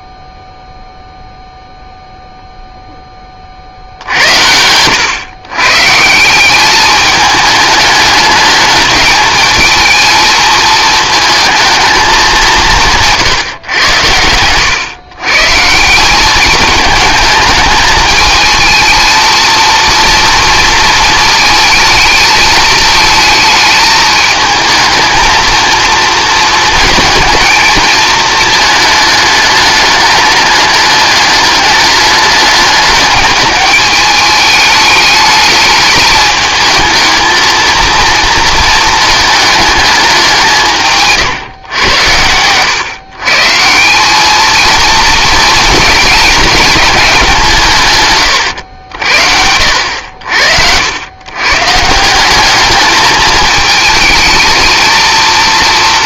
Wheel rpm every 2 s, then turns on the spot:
0, 0, 80, 200, 210, 220, 180, 110, 210, 220, 230, 220, 220, 220, 220, 210, 210, 210, 220, 230, 160, 110, 220, 220, 90, 70, 210, 230.
none